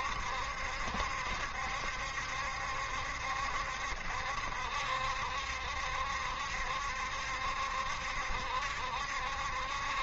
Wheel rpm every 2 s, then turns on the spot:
70, 70, 70, 70, 70.
none